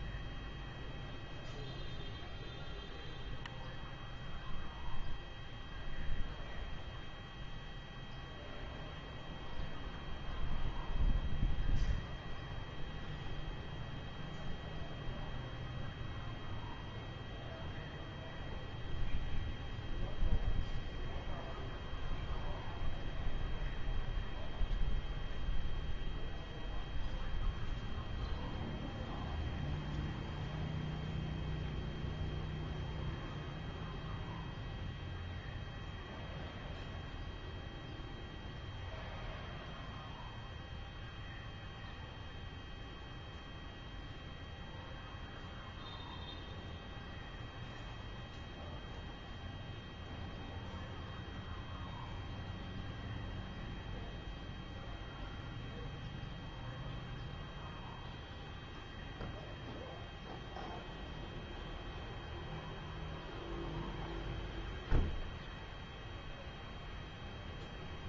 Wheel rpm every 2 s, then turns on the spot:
0, 0, 0, 0, 0, 0, 0, 0, 0, 0, 0, 0, 0, 0, 0, 0, 0, 0, 0, 0, 0, 0, 0, 0, 0, 0, 0, 0, 0, 0, 0, 0, 0, 0.
none